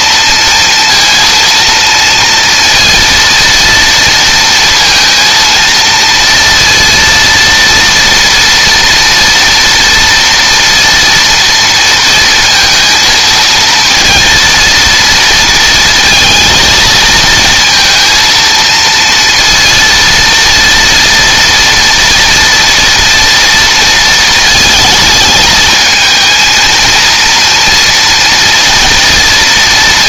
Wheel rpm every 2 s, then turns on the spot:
230, 230, 230, 230, 230, 230, 230, 230, 230, 230, 230, 230, 220, 230, 230.
none